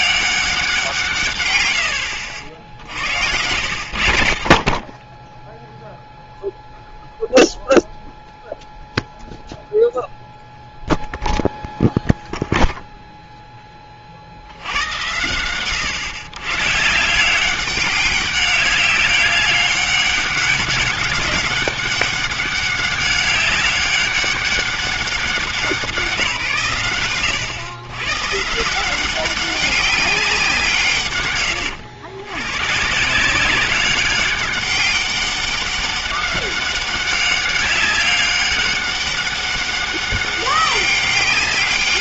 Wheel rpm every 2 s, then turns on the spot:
180, 60, 40, 0, 0, 0, 0, 80, 140, 200, 200, 200, 200, 130, 150, 170, 130, 200, 200, 200, 200.
2-4